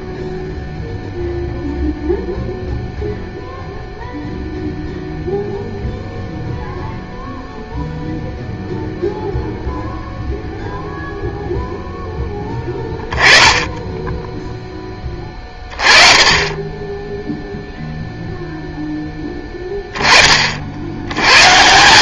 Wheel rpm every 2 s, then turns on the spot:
0, 0, 0, 0, 0, 0, 10, 20, 10, 10, 70.
none